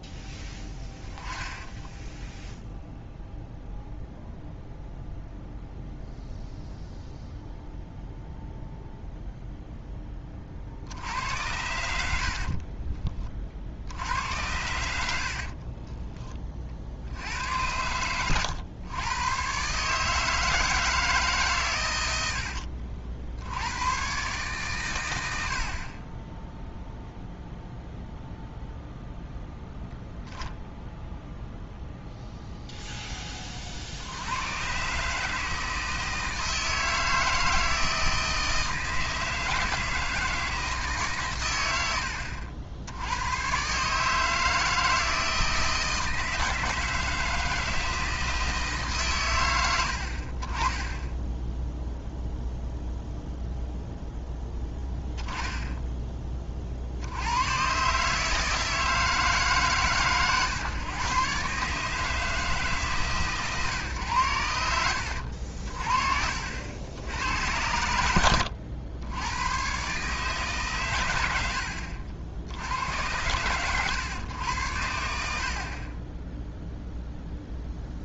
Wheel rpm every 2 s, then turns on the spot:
10, 0, 0, 0, 0, 40, 40, 90, 30, 110, 160, 70, 130, 0, 0, 10, 0, 100, 160, 160, 160, 70, 160, 160, 160, 40, 0, 10, 30, 160, 120, 150, 90, 70, 100, 140, 80, 100, 0.
0-2 12-14